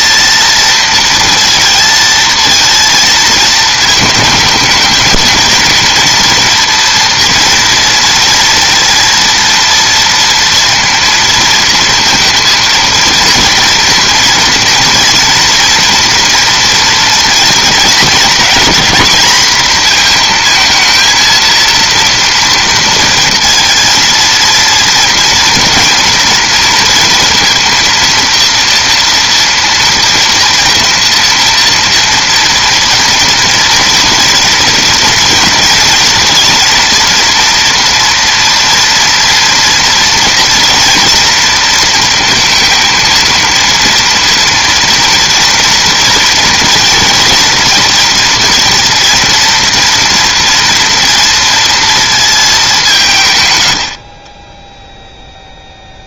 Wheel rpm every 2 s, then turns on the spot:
230, 230, 210, 230, 230, 230, 230, 230, 230, 200, 230, 230, 230, 230, 230, 230, 230, 230, 230, 230, 240, 230, 230, 230, 230, 230, 200, 10.
54-56